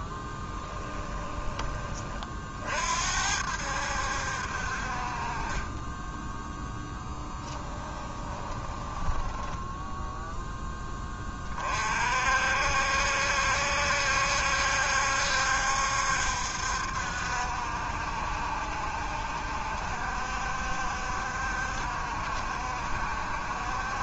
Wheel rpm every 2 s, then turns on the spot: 20, 50, 50, 10, 20, 10, 60, 70, 70, 70, 70, 70.
0-2 6-10